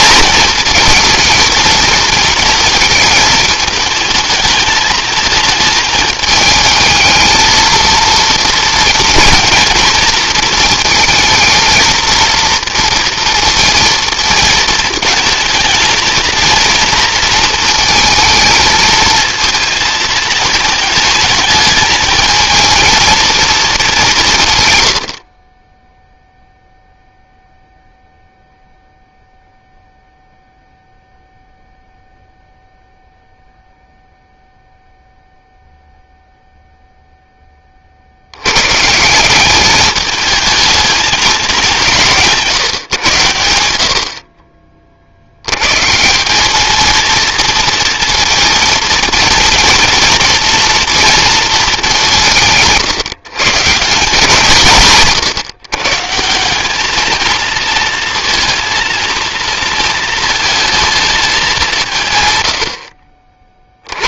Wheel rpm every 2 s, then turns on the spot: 230, 220, 220, 220, 230, 230, 230, 220, 230, 220, 220, 230, 110, 0, 0, 0, 0, 0, 0, 150, 220, 130, 50, 220, 230, 230, 150, 160, 210, 230, 220, 60.
none